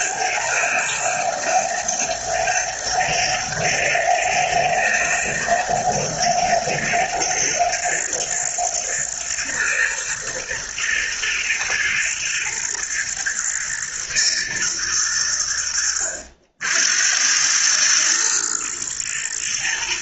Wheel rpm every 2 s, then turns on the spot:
120, 110, 110, 110, 110, 110, 110, 110, 70, 120.
none